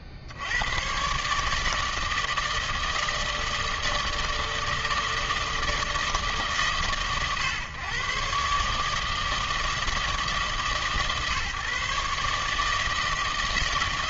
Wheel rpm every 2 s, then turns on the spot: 60, 160, 160, 140, 140, 160, 150.
none